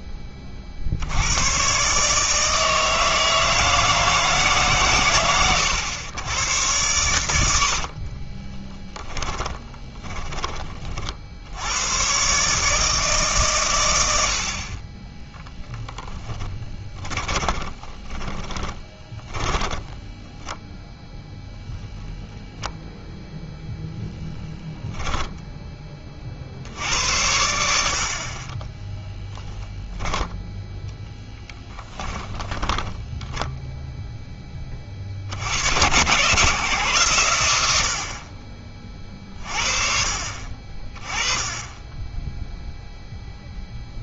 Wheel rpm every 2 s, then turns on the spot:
50, 160, 140, 100, 20, 30, 150, 50, 10, 20, 10, 0, 10, 60, 20, 10, 10, 20, 130, 30, 40, 0.
8-10 18-20 28-30 32-34